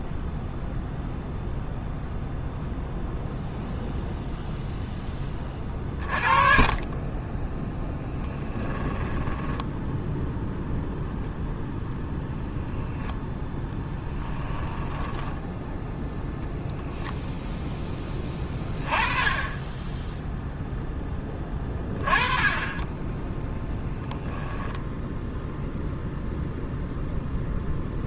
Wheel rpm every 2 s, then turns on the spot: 0, 0, 0, 30, 10, 0, 10, 10, 0, 20, 10, 20, 0, 0.
8-10 14-16